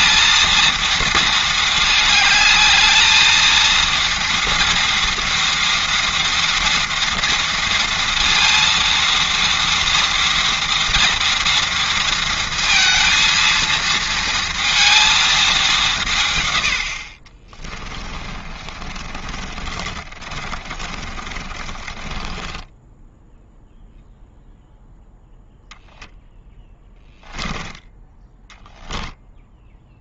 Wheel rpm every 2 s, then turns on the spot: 230, 220, 230, 230, 230, 230, 230, 230, 50, 30, 30, 10, 0, 10, 10.
18-24 28-30